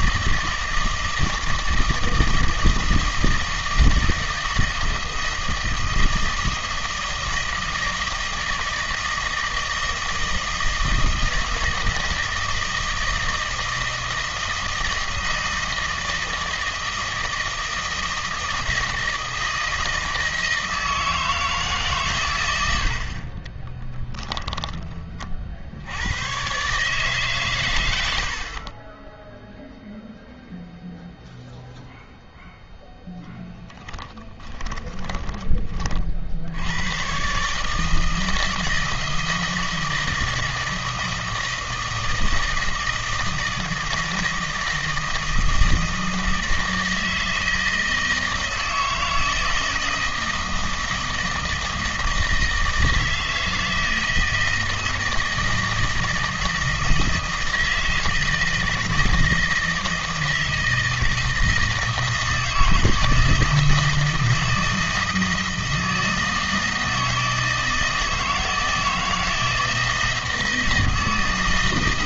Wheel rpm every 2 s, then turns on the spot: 160, 160, 160, 160, 160, 160, 160, 160, 160, 160, 160, 100, 10, 140, 30, 0, 0, 10, 80, 160, 160, 160, 160, 160, 160, 160, 160, 160, 160, 160, 160, 160, 160, 160, 160, 160.
24-26 34-36